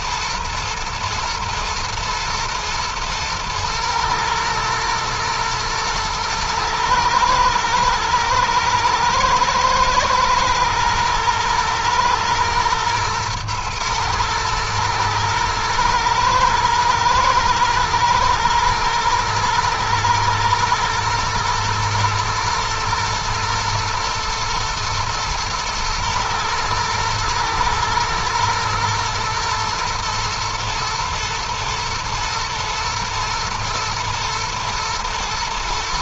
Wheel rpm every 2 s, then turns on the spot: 120, 120, 110, 110, 110, 110, 120, 110, 110, 120, 120, 110, 120, 110, 120, 120, 120, 110.
none